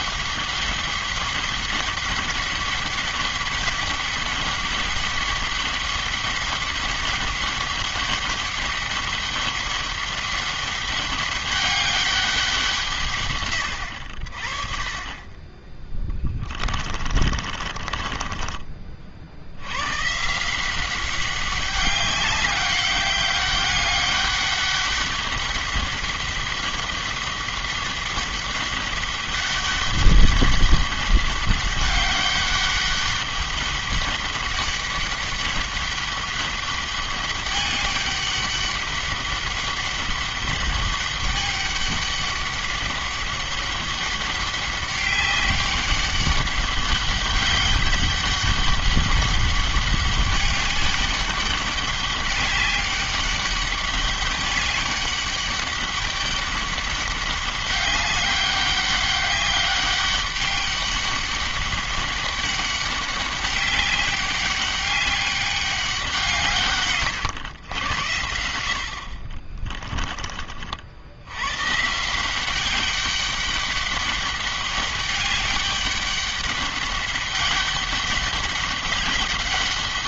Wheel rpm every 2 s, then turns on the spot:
200, 200, 200, 200, 200, 200, 170, 40, 30, 40, 180, 200, 200, 200, 200, 200, 200, 200, 200, 200, 200, 200, 200, 200, 200, 200, 200, 200, 200, 200, 200, 200, 200, 130, 70, 60, 190, 200, 200, 200.
16-20